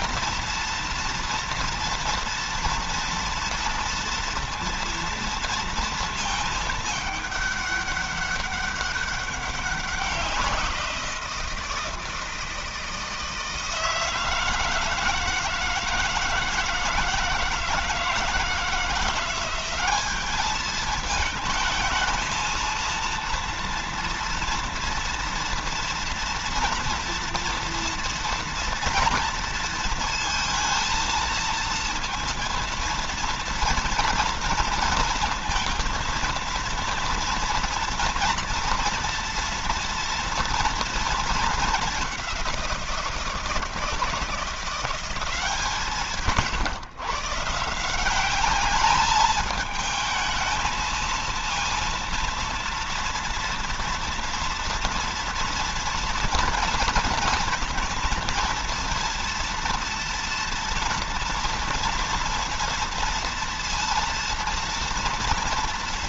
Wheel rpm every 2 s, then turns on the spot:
230, 230, 230, 210, 200, 170, 160, 160, 160, 170, 220, 230, 230, 230, 230, 230, 230, 230, 230, 230, 230, 170, 190, 140, 210, 230, 230, 230, 230, 230, 230, 230, 230.
none